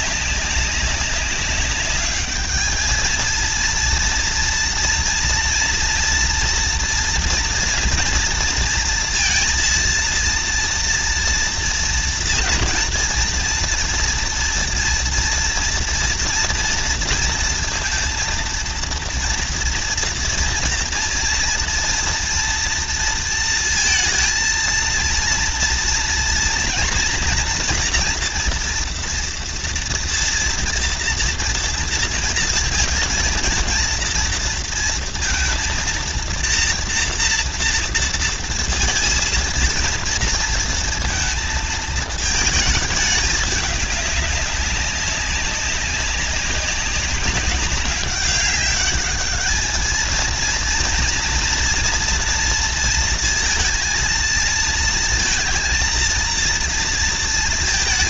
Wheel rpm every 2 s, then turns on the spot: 190, 220, 230, 230, 230, 230, 230, 230, 230, 230, 230, 240, 230, 230, 240, 230, 230, 230, 230, 230, 230, 220, 200, 200, 200, 230, 230, 230, 230.
none